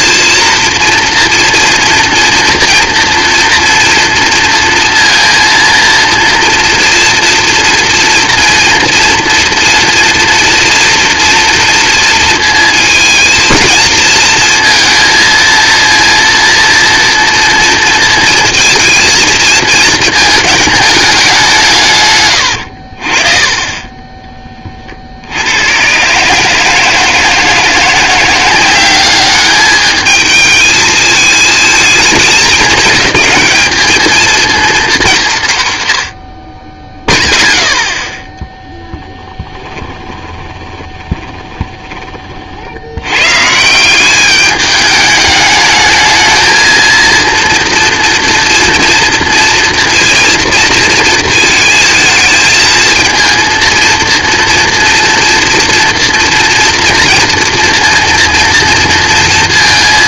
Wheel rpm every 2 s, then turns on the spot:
230, 240, 230, 230, 230, 230, 230, 230, 230, 230, 220, 90, 20, 150, 180, 220, 200, 230, 50, 0, 20, 60, 210, 220, 240, 230, 220, 230, 230, 230.
40-42